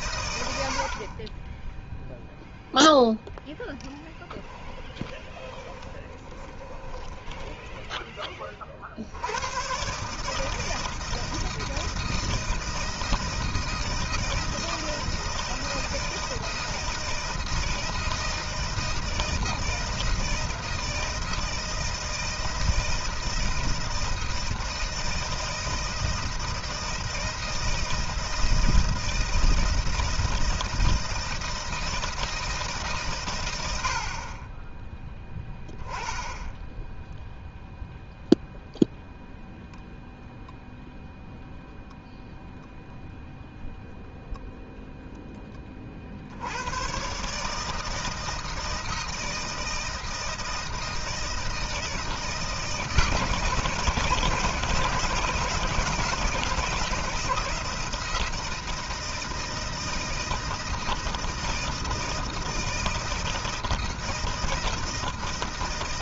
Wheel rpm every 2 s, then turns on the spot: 70, 0, 20, 20, 50, 160, 160, 160, 160, 160, 160, 160, 160, 160, 160, 160, 150, 30, 10, 0, 0, 0, 0, 110, 160, 160, 160, 160, 160, 160, 160, 160, 160.
4-8